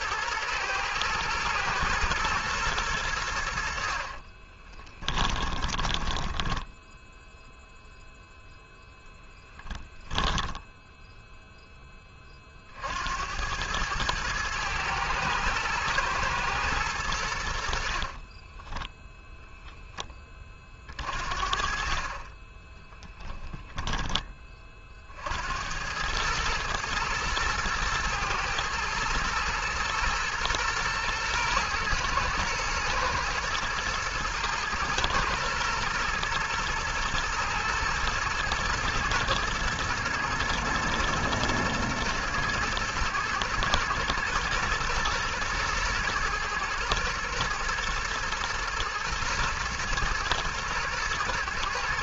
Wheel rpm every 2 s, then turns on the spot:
120, 40, 10, 0, 10, 60, 110, 110, 10, 50, 20, 30, 110, 110, 120, 120, 120, 120, 110, 110, 120, 120, 110, 110, 110, 110.
2-6 8-10 16-18